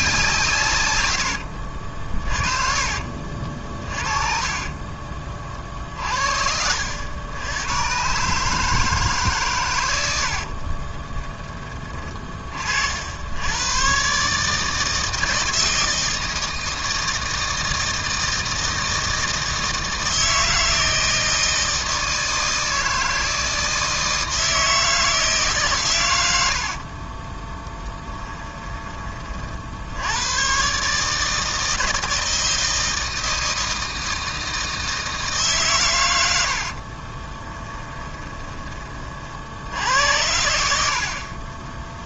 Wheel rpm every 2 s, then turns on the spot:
120, 40, 30, 70, 150, 20, 60, 160, 160, 160, 160, 160, 160, 40, 20, 140, 160, 160, 60, 30, 60.
2-6 10-12 26-28 36-38 40-42